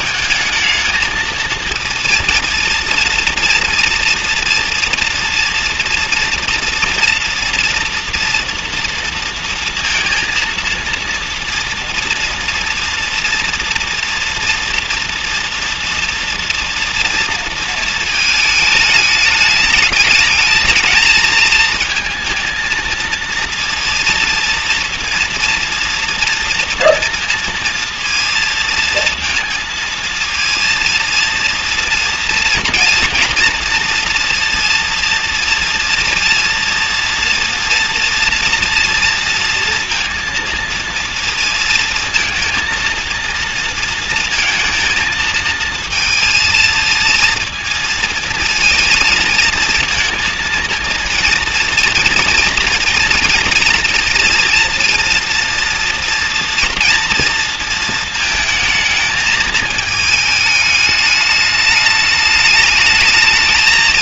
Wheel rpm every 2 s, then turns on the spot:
220, 230, 230, 230, 230, 230, 230, 230, 240, 220, 220, 230, 230, 230, 230, 230, 230, 230, 230, 230, 230, 230, 230, 220, 230, 230, 240, 230, 230, 220, 210, 210.
none